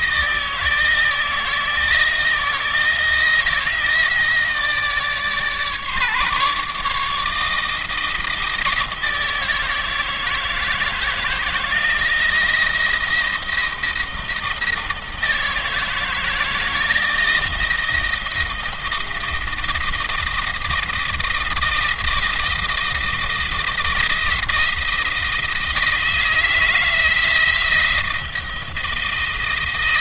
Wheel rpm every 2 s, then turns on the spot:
160, 170, 150, 150, 160, 160, 170, 160, 160, 160, 160, 170, 170, 170, 160.
none